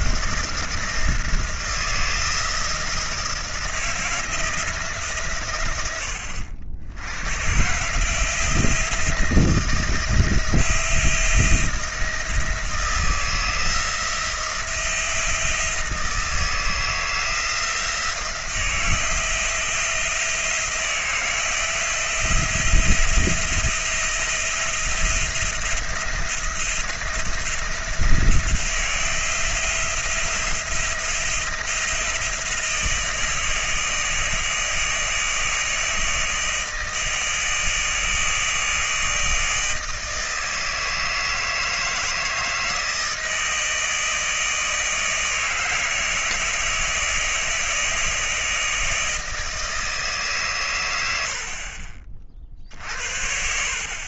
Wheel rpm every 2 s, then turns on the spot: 170, 170, 160, 90, 160, 170, 160, 170, 160, 170, 170, 170, 170, 170, 170, 170, 170, 160, 160, 160, 160, 160, 160, 160, 160, 150, 50.
none